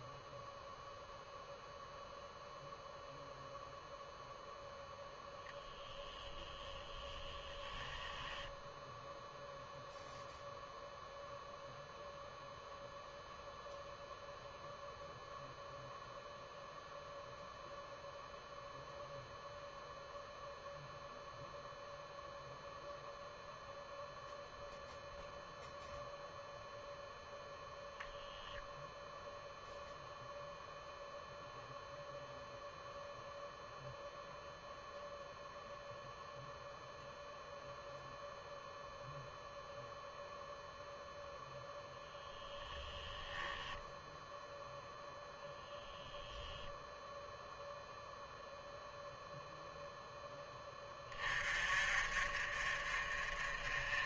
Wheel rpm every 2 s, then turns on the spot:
0, 0, 0, 0, 0, 0, 0, 0, 0, 0, 0, 0, 0, 0, 0, 0, 0, 0, 0, 0, 0, 10, 0, 0, 0, 30, 40.
none